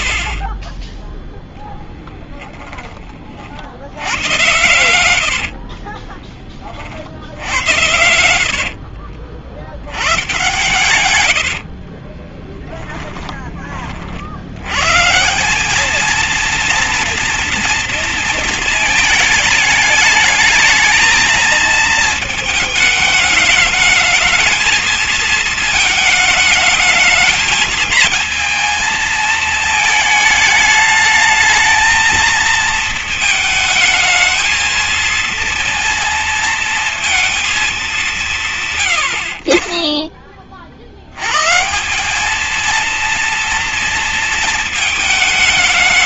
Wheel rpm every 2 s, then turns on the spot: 10, 20, 90, 40, 60, 110, 20, 120, 230, 220, 220, 220, 220, 220, 220, 220, 230, 230, 230, 130, 60, 230, 220.
4-6 8-14